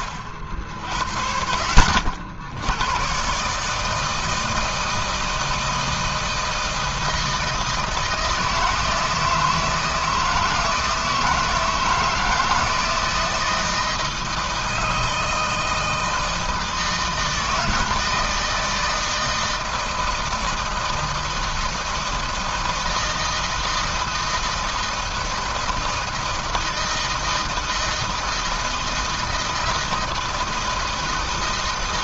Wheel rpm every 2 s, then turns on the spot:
50, 80, 160, 160, 160, 160, 160, 160, 160, 160, 160, 160, 160, 160, 160, 160.
none